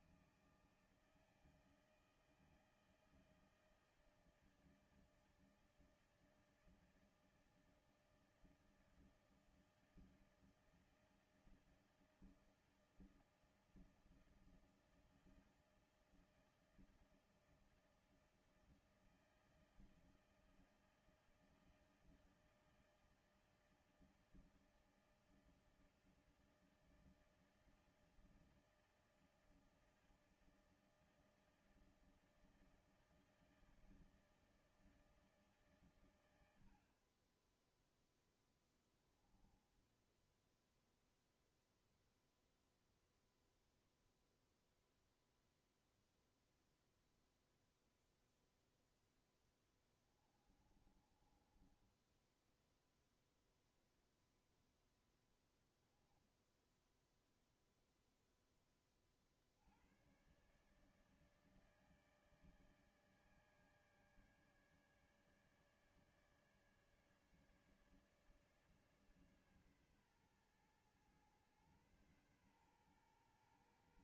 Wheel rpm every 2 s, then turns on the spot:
160, 160, 160, 160, 160, 160, 160, 160, 160, 160, 160, 160, 160, 160, 160, 160, 160, 160, 80, 10, 0, 0, 0, 0, 0, 20, 10, 0, 0, 10, 130, 150, 150, 150, 150, 120, 120.
50-54